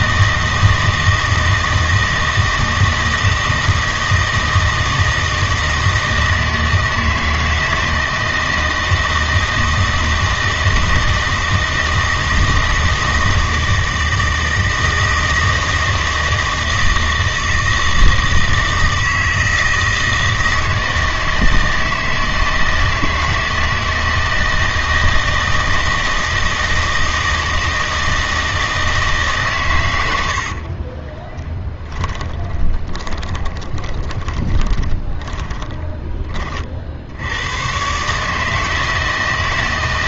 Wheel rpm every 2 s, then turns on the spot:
160, 160, 160, 160, 160, 160, 160, 160, 160, 160, 160, 160, 160, 160, 160, 40, 20, 30, 40, 160.
30-36